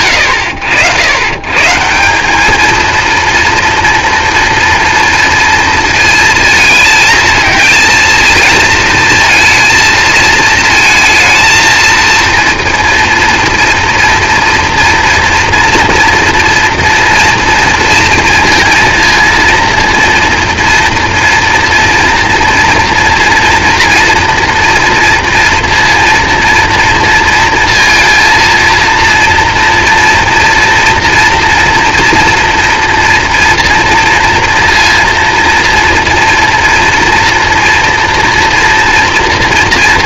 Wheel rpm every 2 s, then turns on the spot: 100, 220, 230, 220, 230, 230, 230, 230, 230, 230, 230, 230, 230, 230, 230, 230, 230, 230, 230, 230.
none